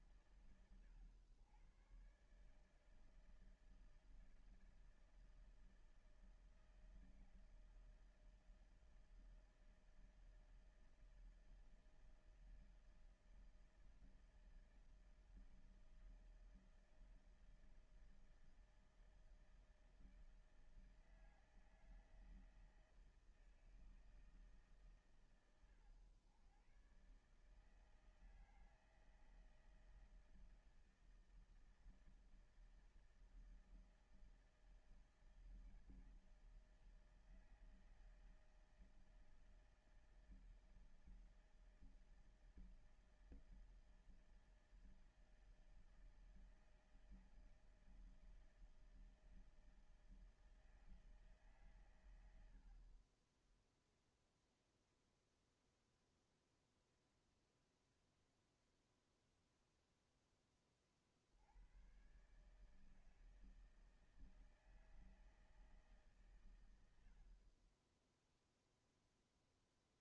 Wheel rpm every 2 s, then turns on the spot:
120, 140, 160, 160, 160, 160, 160, 160, 160, 160, 160, 160, 140, 110, 160, 160, 160, 160, 160, 160, 160, 160, 160, 160, 160, 160, 90, 0, 0, 0, 10, 130, 160, 130, 10.
none